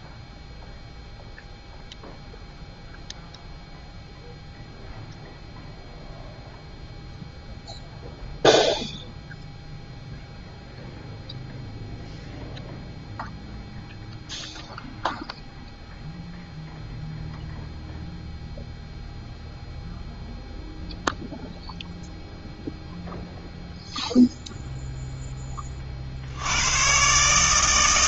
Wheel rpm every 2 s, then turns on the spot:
0, 0, 0, 0, 0, 0, 0, 0, 0, 0, 0, 0, 0, 100.
none